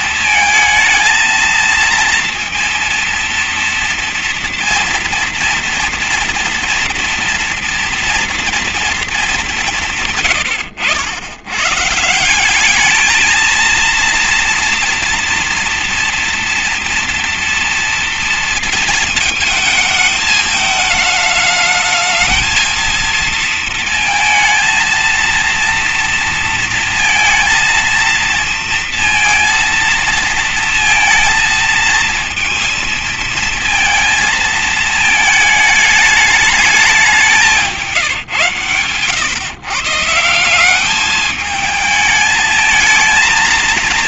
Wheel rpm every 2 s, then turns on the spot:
220, 230, 230, 230, 230, 110, 190, 230, 230, 230, 220, 220, 220, 230, 230, 230, 230, 220, 220, 130, 180, 220.
10-12